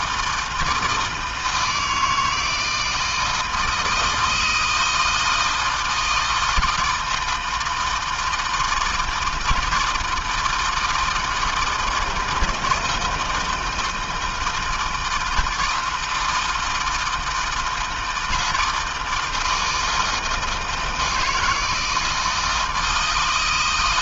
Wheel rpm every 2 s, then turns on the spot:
160, 160, 160, 160, 160, 160, 160, 160, 160, 160, 160, 140.
none